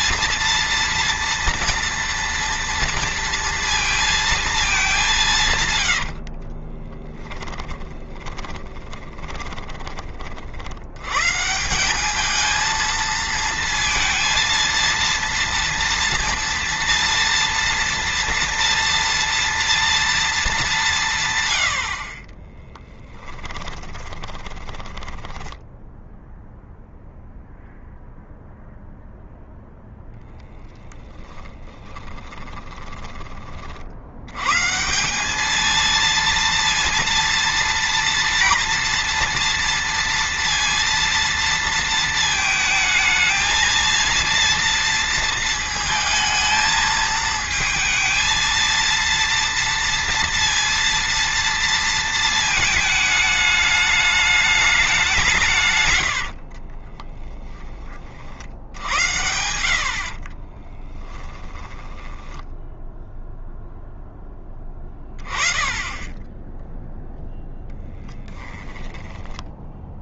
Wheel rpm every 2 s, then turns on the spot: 230, 230, 200, 20, 20, 80, 220, 230, 230, 230, 190, 20, 10, 0, 0, 10, 20, 160, 230, 230, 230, 220, 230, 220, 230, 230, 220, 200, 40, 90, 30, 0, 20, 10, 10.
6-10 22-26 32-34 56-58 60-62 68-70